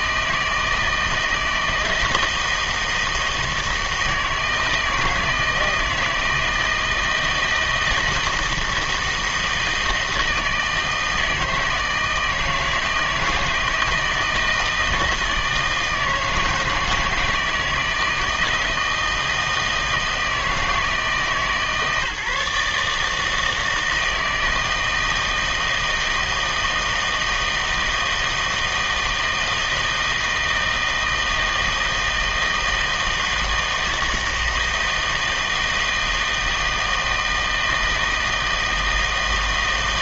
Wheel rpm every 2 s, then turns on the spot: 160, 160, 160, 160, 160, 160, 160, 160, 160, 160, 160, 150, 160, 160, 160, 160, 160, 160, 160, 160.
none